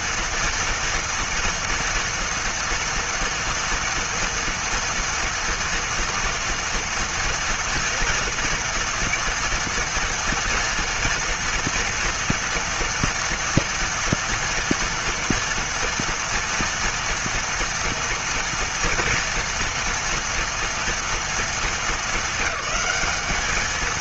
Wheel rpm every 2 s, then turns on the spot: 230, 230, 230, 230, 230, 230, 230, 240, 230, 230, 230, 210.
none